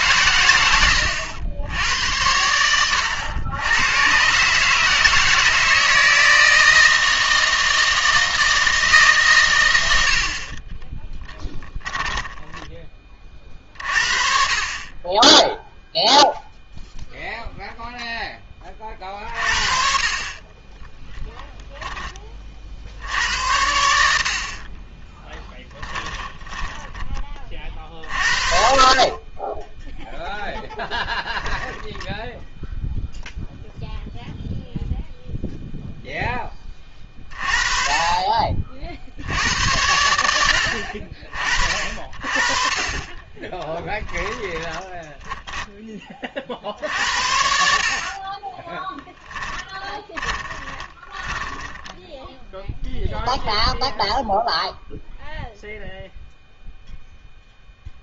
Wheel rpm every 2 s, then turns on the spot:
100, 90, 150, 160, 160, 30, 20, 50, 0, 20, 20, 50, 30, 10, 30, 10, 0, 0, 20, 50, 60, 40, 20, 50, 20, 20, 0, 0, 0.
24-28 44-46 48-52